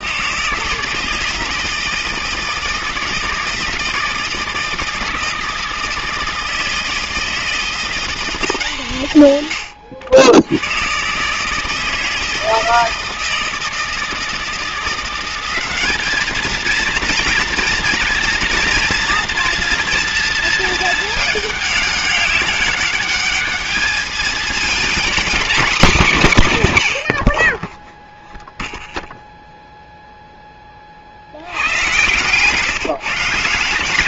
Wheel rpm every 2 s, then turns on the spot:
150, 160, 170, 160, 170, 100, 160, 170, 220, 230, 220, 200, 230, 150, 0, 20, 150.
none